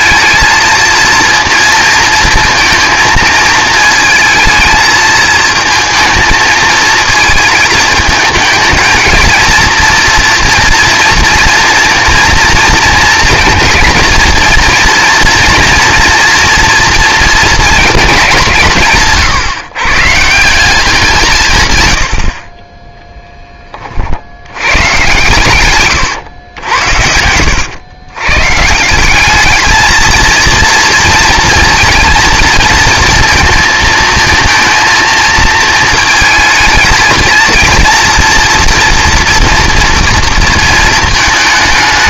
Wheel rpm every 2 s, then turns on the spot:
230, 230, 220, 220, 220, 230, 230, 230, 230, 160, 190, 30, 100, 80, 140, 230, 230, 230, 220, 230, 230.
none